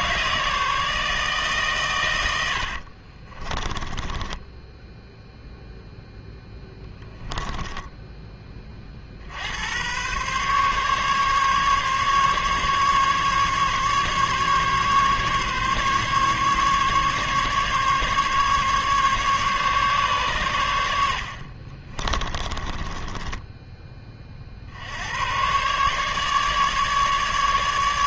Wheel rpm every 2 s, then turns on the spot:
80, 10, 0, 20, 130, 140, 140, 140, 140, 130, 30, 40, 150, 150.
0-4 20-22